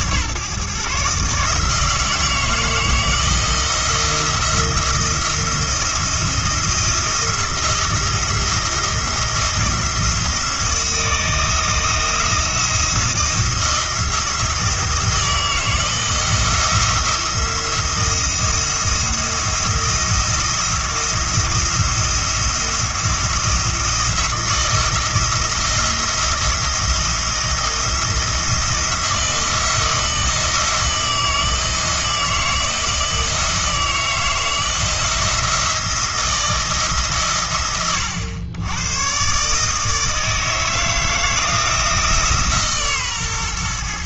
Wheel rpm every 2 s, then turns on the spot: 140, 160, 170, 170, 170, 160, 170, 160, 170, 170, 170, 170, 160, 160, 160, 160, 160, 160, 150, 110, 160, 140.
none